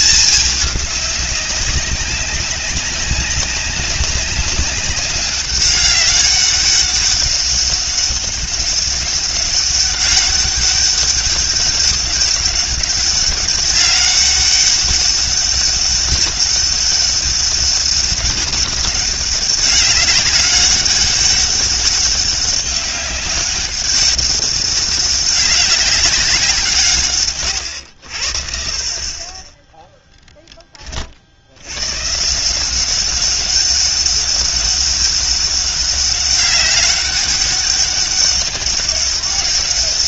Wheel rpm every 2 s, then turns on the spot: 200, 200, 200, 200, 200, 200, 190, 200, 200, 200, 200, 200, 200, 150, 40, 40, 190, 190, 190, 200.
none